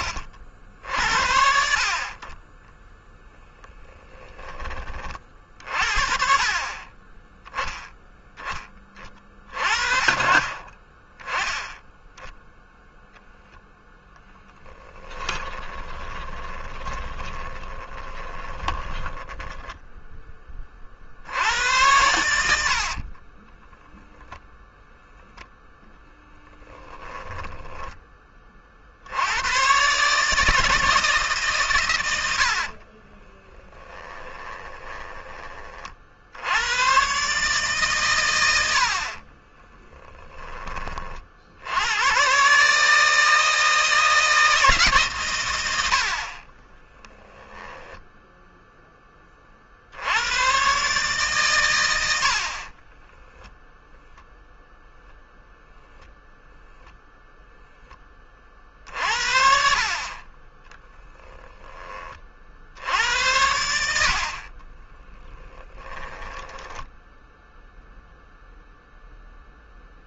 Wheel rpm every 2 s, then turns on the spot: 60, 20, 30, 30, 20, 40, 0, 10, 20, 20, 30, 70, 0, 0, 40, 160, 60, 20, 90, 90, 20, 130, 150, 30, 0, 110, 30, 0, 0, 30, 20, 60, 50, 10, 0.
2-4 14-20 32-36 46-48 52-54 60-62 64-68